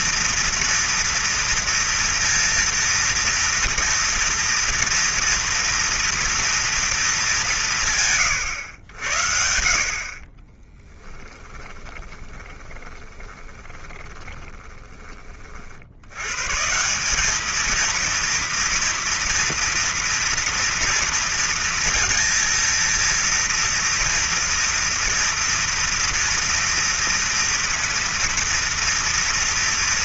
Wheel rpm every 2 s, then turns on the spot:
230, 230, 230, 220, 80, 20, 20, 20, 180, 230, 230, 230, 230, 230, 230.
10-16